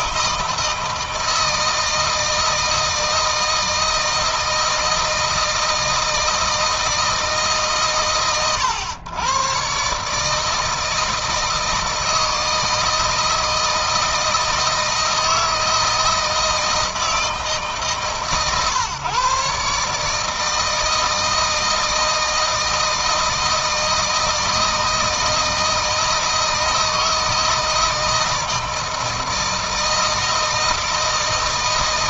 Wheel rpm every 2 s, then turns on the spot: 160, 160, 160, 160, 110, 160, 160, 160, 160, 130, 160, 160, 160, 160, 160, 160.
none